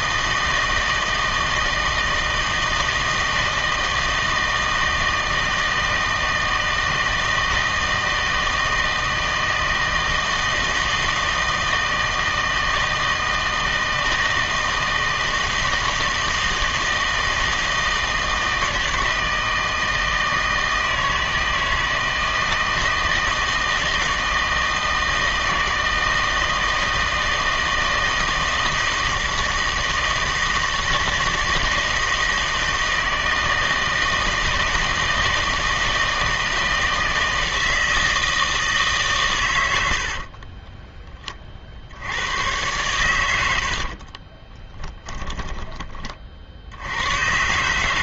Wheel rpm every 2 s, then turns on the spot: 160, 160, 160, 160, 160, 160, 160, 160, 160, 160, 160, 160, 160, 160, 160, 160, 160, 160, 160, 160, 20, 110, 20, 70.
40-42 44-46